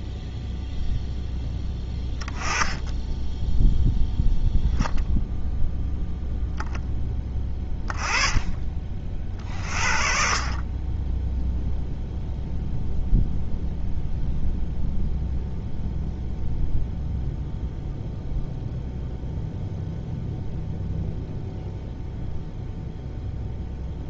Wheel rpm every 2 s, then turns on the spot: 0, 10, 0, 10, 30, 20, 0, 0, 0, 0, 0, 0.
none